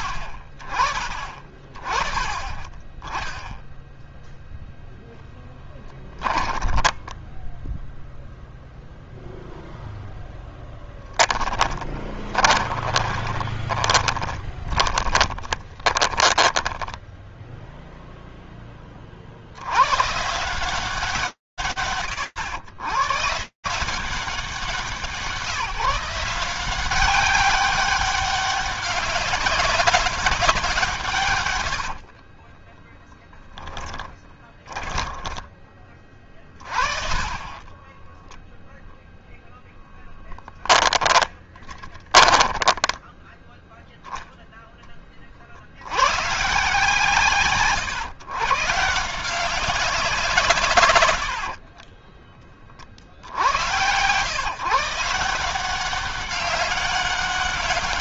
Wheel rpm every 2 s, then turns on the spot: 40, 20, 0, 10, 0, 0, 20, 20, 10, 10, 150, 130, 170, 190, 200, 120, 20, 20, 30, 0, 10, 10, 40, 140, 170, 80, 90, 170, 200.
6-8 12-18 32-36 40-42 50-52